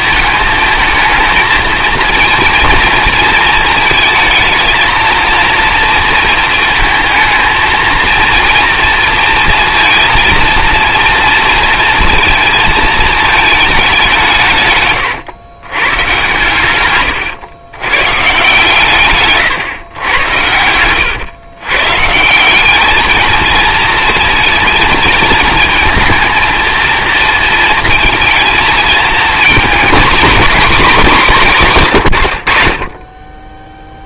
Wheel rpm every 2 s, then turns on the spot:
220, 230, 220, 230, 230, 230, 230, 140, 120, 150, 90, 190, 220, 230, 230, 230, 70.
20-22